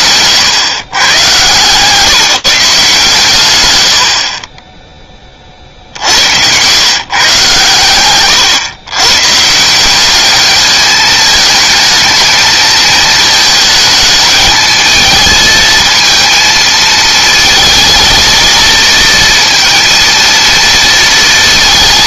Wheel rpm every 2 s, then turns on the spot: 120, 140, 20, 120, 120, 210, 220, 220, 220, 230, 230.
none